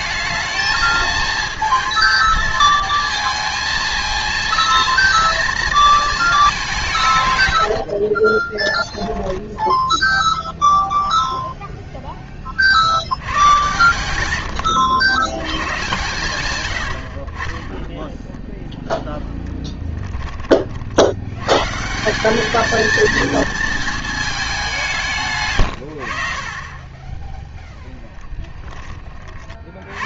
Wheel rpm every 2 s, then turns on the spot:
220, 220, 230, 190, 20, 0, 60, 100, 90, 0, 50, 220, 190, 30, 20.
8-10